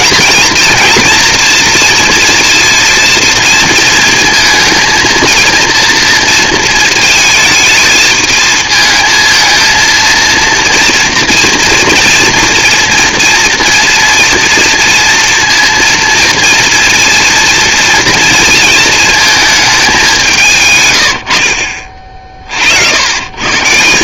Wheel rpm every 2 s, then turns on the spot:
230, 230, 230, 230, 220, 230, 230, 230, 230, 230, 150, 60.
none